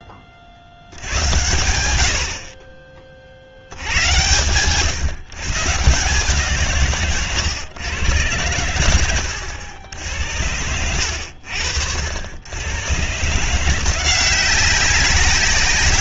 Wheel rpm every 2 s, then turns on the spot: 80, 40, 130, 130, 100, 80, 130, 190.
none